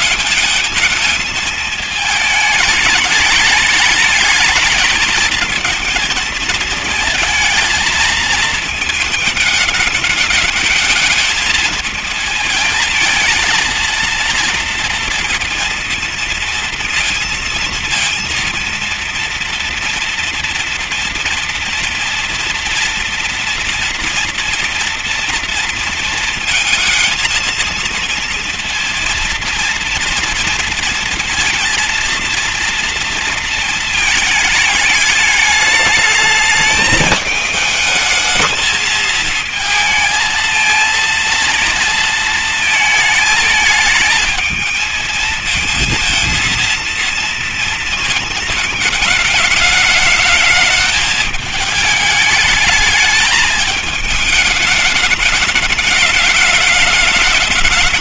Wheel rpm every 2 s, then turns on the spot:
220, 210, 220, 230, 220, 220, 230, 240, 230, 230, 230, 230, 240, 230, 230, 230, 230, 220, 210, 220, 220, 230, 220, 230, 220, 220, 210, 210, 210.
none